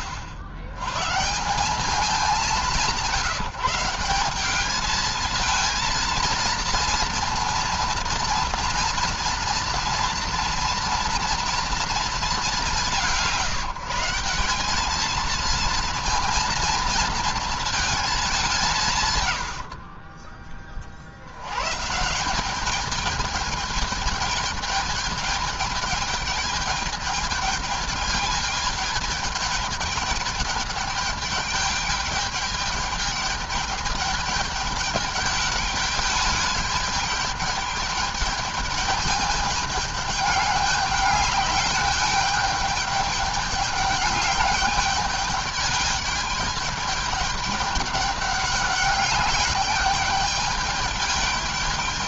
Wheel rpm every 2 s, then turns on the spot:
80, 180, 210, 230, 240, 230, 170, 210, 220, 170, 30, 200, 210, 210, 220, 210, 210, 210, 210, 210, 200, 210, 200, 210, 200, 210.
none